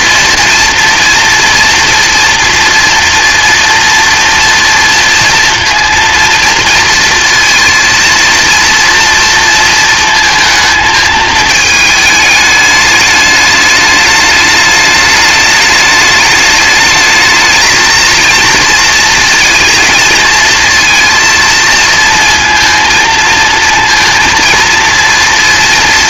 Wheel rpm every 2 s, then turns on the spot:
230, 240, 230, 230, 230, 220, 210, 210, 210, 230, 230, 230, 230.
none